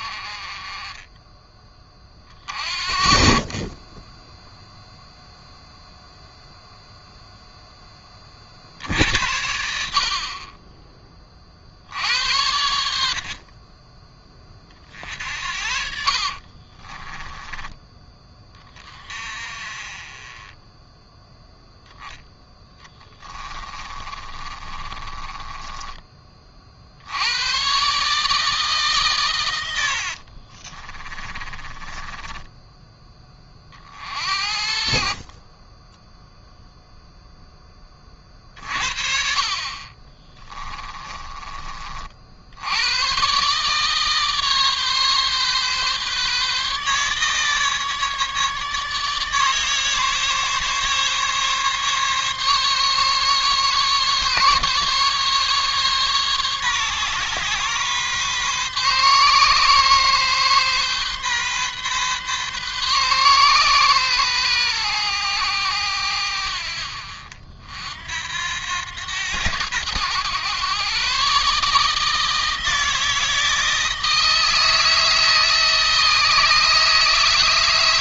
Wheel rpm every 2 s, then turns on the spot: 30, 30, 0, 0, 60, 20, 70, 40, 20, 30, 10, 10, 20, 60, 140, 40, 10, 50, 0, 40, 20, 100, 140, 150, 150, 140, 140, 140, 140, 130, 130, 130, 110, 60, 90, 130, 160, 160, 160.
16-18 22-26 30-32 40-42